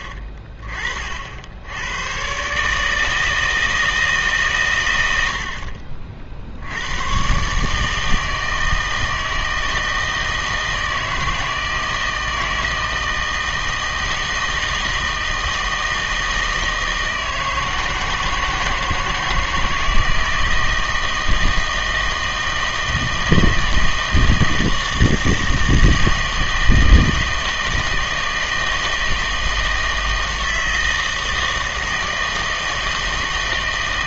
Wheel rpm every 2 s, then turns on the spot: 40, 150, 110, 90, 160, 160, 160, 160, 160, 160, 160, 160, 160, 160, 160, 160, 160.
none